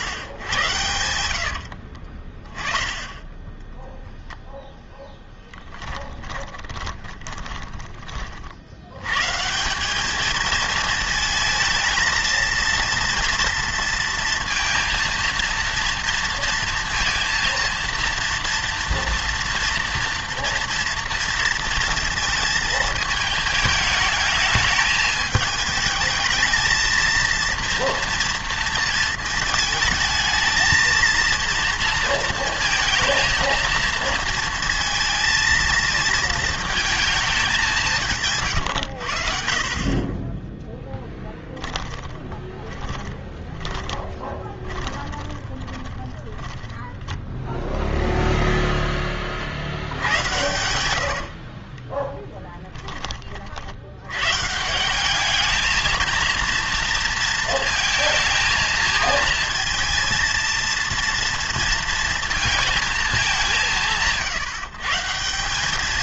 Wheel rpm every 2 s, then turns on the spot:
100, 20, 0, 20, 70, 220, 230, 230, 230, 230, 230, 220, 210, 230, 230, 220, 230, 230, 220, 110, 10, 20, 20, 10, 0, 100, 20, 160, 230, 220, 230, 220, 140.
6-8 42-48 50-54